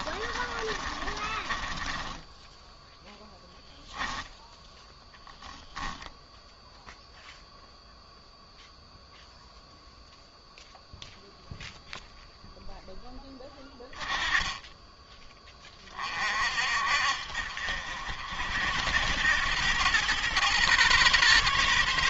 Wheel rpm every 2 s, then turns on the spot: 30, 10, 10, 0, 0, 0, 0, 20, 50, 70, 120.
0-2